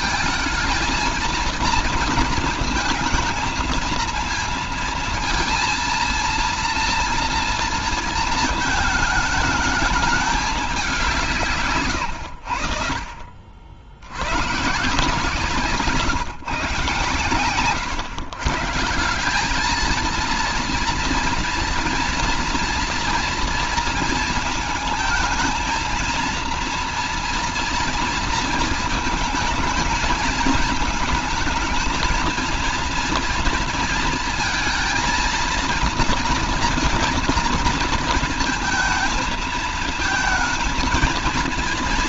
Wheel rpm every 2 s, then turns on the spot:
220, 220, 230, 230, 220, 210, 90, 120, 140, 140, 230, 240, 230, 230, 230, 220, 230, 230, 230, 230, 230.
none